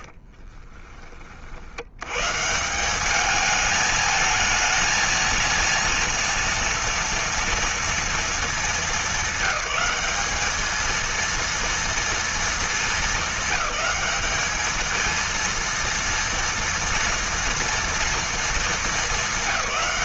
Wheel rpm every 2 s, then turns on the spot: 30, 190, 220, 230, 210, 220, 210, 210, 230, 220.
0-2